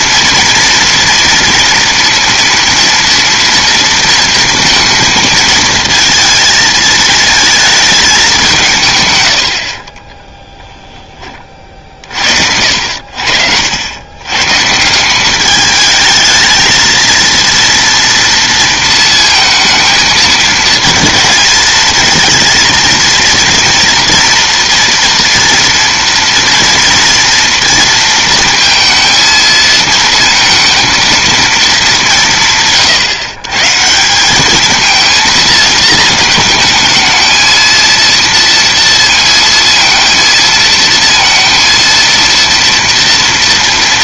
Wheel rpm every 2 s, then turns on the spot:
230, 230, 230, 230, 170, 10, 60, 140, 220, 230, 220, 230, 230, 230, 230, 230, 160, 210, 220, 230, 230, 230.
none